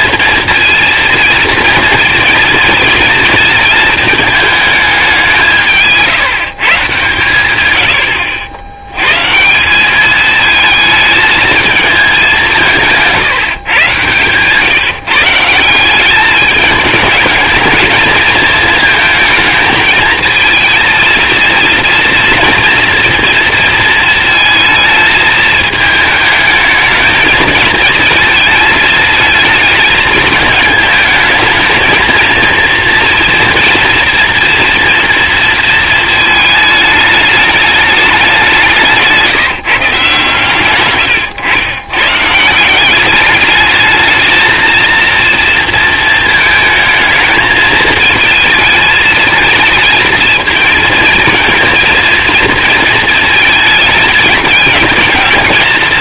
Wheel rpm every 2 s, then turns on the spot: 230, 230, 160, 100, 180, 220, 130, 170, 220, 220, 230, 230, 220, 220, 220, 220, 240, 230, 210, 150, 110, 210, 230, 220, 220, 230, 220, 220.
none